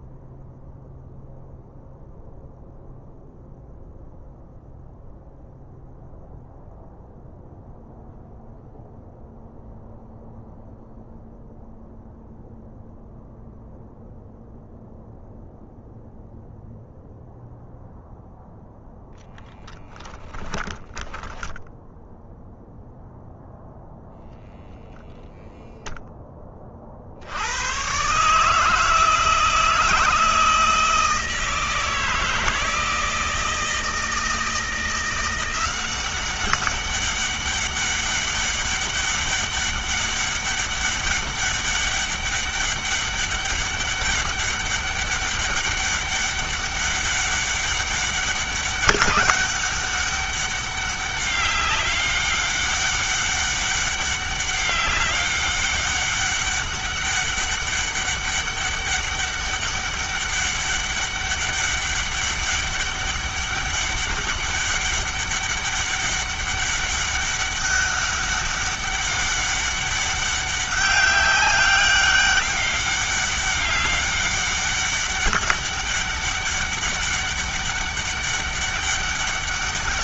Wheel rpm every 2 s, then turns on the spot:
0, 0, 0, 0, 0, 0, 0, 0, 0, 0, 10, 0, 0, 40, 160, 160, 160, 170, 200, 200, 200, 200, 200, 200, 200, 200, 200, 200, 200, 200, 200, 200, 200, 200, 200, 200, 200, 200, 200, 200.
20-22